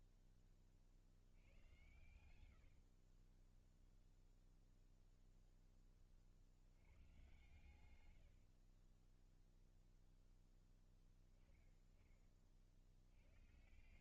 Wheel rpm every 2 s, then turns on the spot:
20, 90, 0, 50, 70, 0, 40.
2-4 8-10